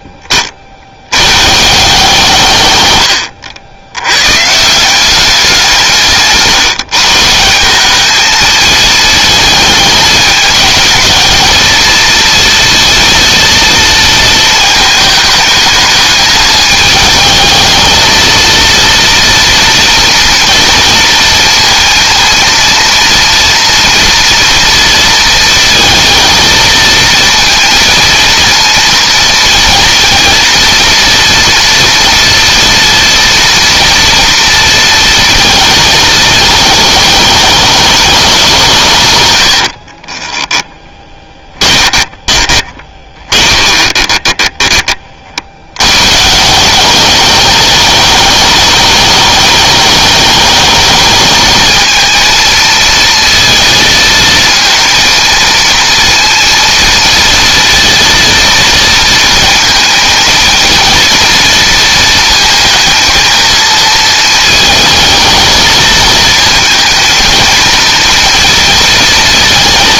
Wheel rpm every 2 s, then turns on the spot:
30, 130, 150, 160, 220, 220, 230, 220, 220, 230, 230, 230, 230, 230, 230, 230, 230, 230, 220, 170, 10, 20, 30, 200, 210, 220, 230, 230, 230, 230, 230, 220, 220, 220, 230.
40-44